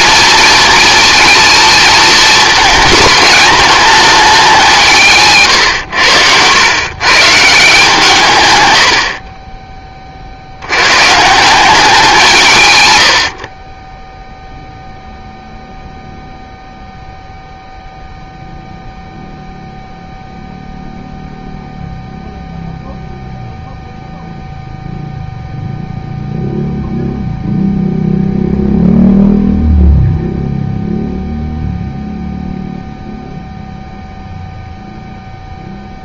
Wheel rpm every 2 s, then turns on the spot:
220, 220, 170, 110, 110, 100, 120, 0, 0, 0, 0, 0, 0, 0, 0, 0, 0, 0.
none